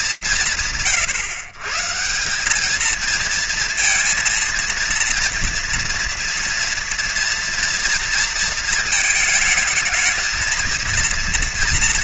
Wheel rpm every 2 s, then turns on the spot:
140, 230, 230, 230, 220, 230.
none